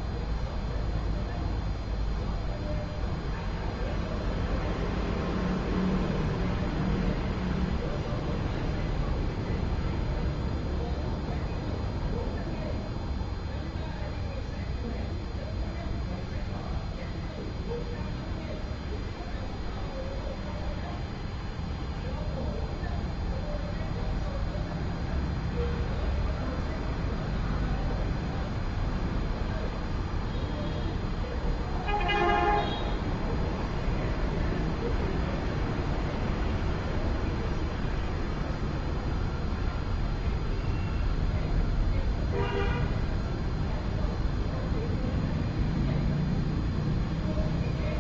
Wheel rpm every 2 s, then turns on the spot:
0, 0, 0, 0, 0, 0, 0, 0, 0, 0, 0, 0, 0, 0, 0, 0, 0, 0, 0, 0, 0, 0, 0, 0.
none